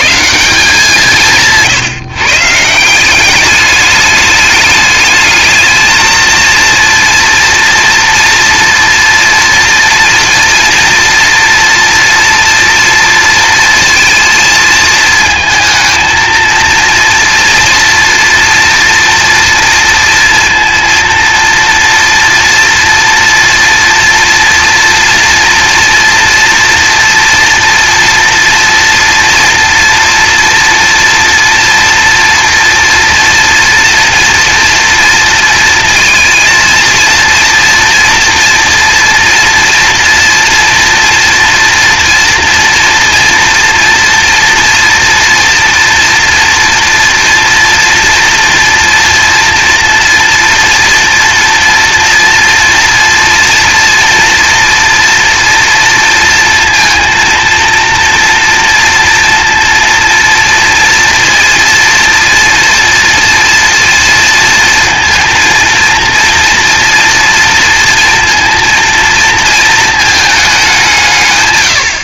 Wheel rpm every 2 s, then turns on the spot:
180, 160, 210, 230, 230, 230, 230, 220, 230, 230, 230, 240, 230, 230, 230, 230, 230, 230, 230, 230, 240, 230, 240, 240, 230, 230, 240, 230, 230, 240, 230, 230, 230, 240, 230, 200.
none